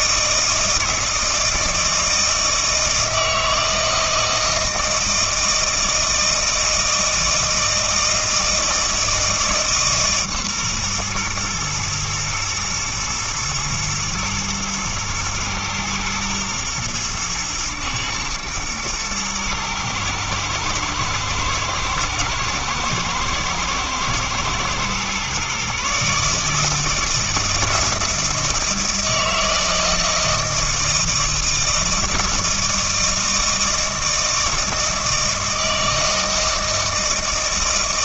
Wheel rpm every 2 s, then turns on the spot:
160, 160, 160, 160, 160, 130, 120, 120, 110, 110, 110, 120, 120, 160, 170, 160, 160, 160, 160.
none